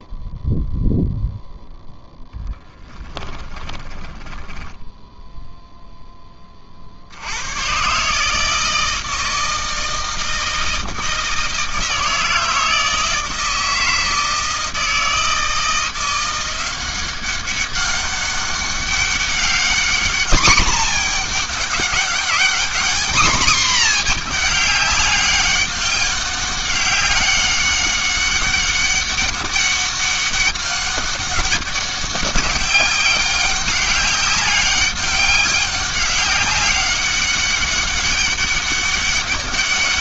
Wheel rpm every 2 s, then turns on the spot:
0, 10, 10, 60, 160, 160, 160, 160, 190, 200, 220, 230, 200, 200, 200, 200, 190, 200, 200, 200.
2-6